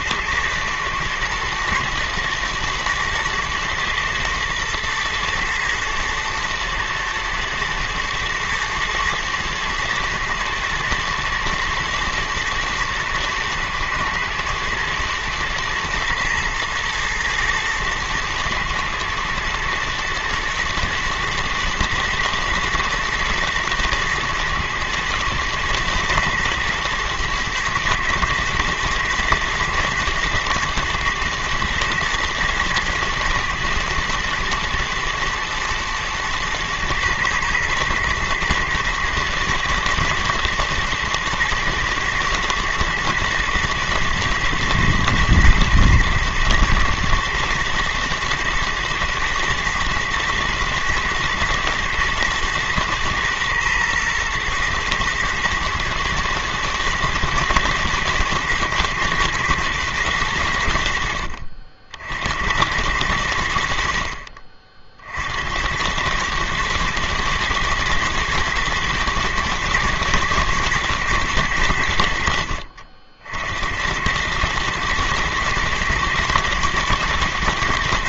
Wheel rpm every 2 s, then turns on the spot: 110, 110, 110, 110, 110, 120, 120, 110, 110, 110, 120, 120, 110, 120, 120, 110, 120, 120, 110, 120, 120, 110, 120, 110, 120, 120, 120, 110, 120, 110, 60, 90, 70, 110, 110, 110, 60, 110, 110.
none